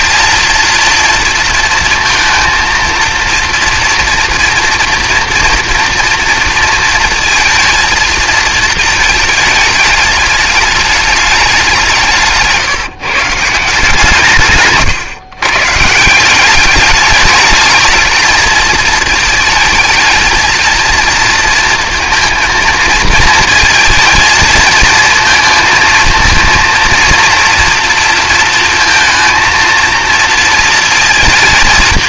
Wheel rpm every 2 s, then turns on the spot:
230, 230, 230, 220, 220, 210, 160, 130, 210, 220, 230, 220, 230, 230, 230, 220.
none